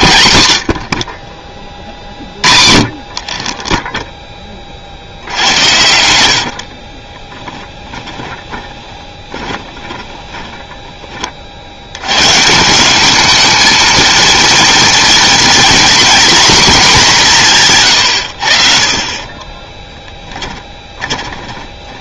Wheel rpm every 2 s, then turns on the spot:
110, 60, 20, 70, 20, 20, 150, 230, 240, 60, 20.
6-12 20-22